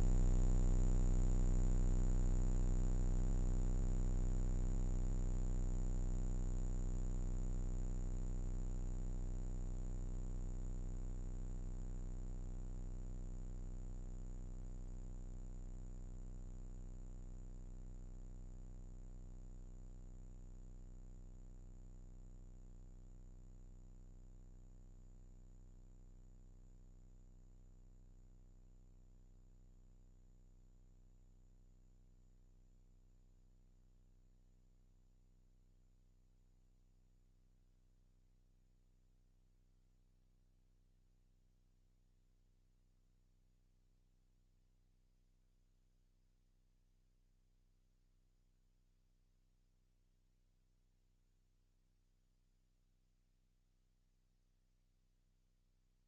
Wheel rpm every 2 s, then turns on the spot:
0, 0, 0, 0, 0, 0, 0, 0, 0, 0, 0, 0, 0, 0, 0, 0, 0, 0, 0, 0, 0, 0, 0, 0, 0, 0, 0, 0.
none